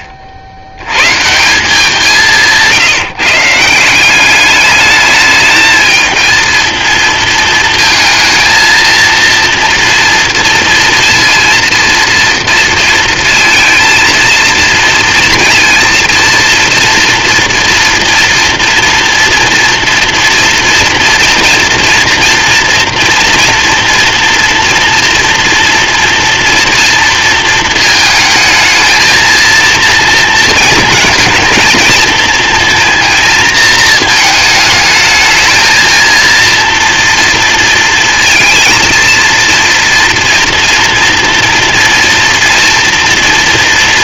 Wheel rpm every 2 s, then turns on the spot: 60, 170, 200, 230, 230, 230, 230, 230, 230, 240, 230, 230, 240, 230, 220, 230, 230, 220, 230, 230, 230, 230.
none